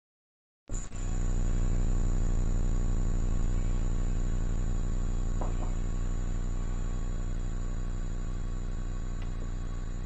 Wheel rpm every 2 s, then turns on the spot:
0, 0, 0, 0, 0.
none